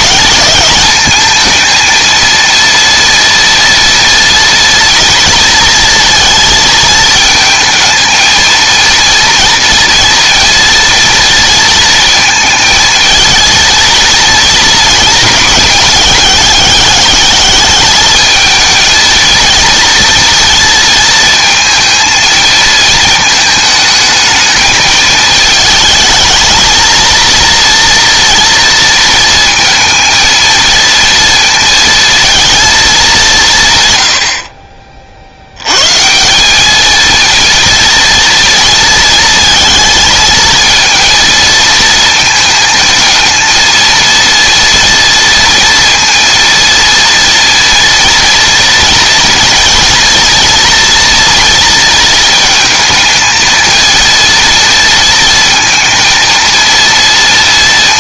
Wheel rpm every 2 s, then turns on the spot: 220, 230, 230, 220, 230, 230, 220, 220, 200, 230, 230, 220, 220, 230, 230, 230, 210, 40, 220, 230, 230, 230, 230, 230, 230, 230, 220, 230, 230.
none